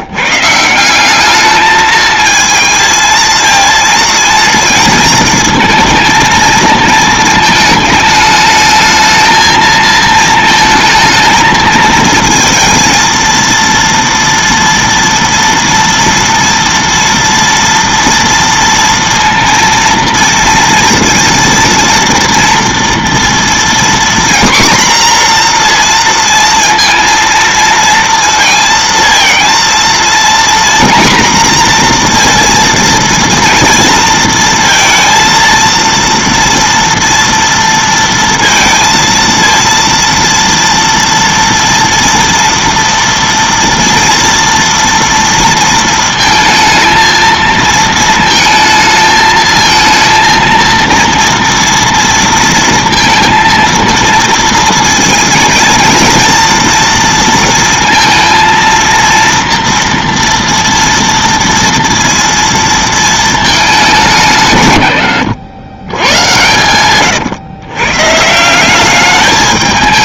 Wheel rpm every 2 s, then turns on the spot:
160, 220, 230, 220, 220, 230, 230, 230, 230, 230, 230, 230, 240, 230, 230, 240, 230, 230, 230, 230, 230, 230, 230, 220, 220, 230, 230, 230, 230, 230, 230, 230, 120, 110, 180.
66-68